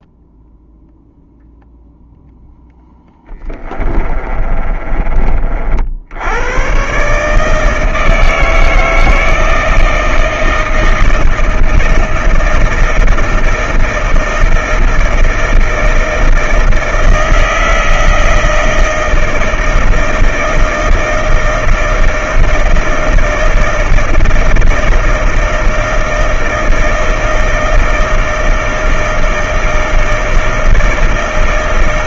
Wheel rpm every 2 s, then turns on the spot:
0, 0, 30, 100, 160, 160, 160, 160, 160, 160, 160, 160, 160, 160, 160, 160.
4-6